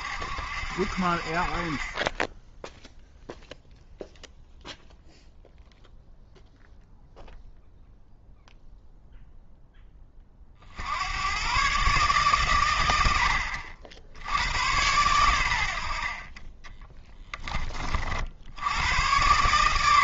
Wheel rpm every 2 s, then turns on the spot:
60, 0, 0, 0, 0, 60, 90, 100, 10, 100.
16-18